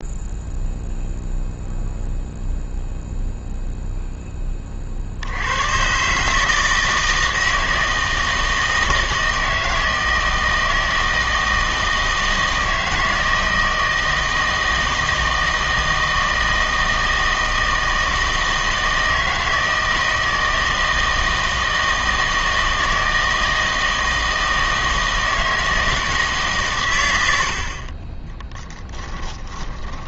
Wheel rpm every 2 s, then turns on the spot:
0, 0, 30, 160, 160, 160, 160, 160, 160, 160, 160, 160, 160, 120, 10.
28-30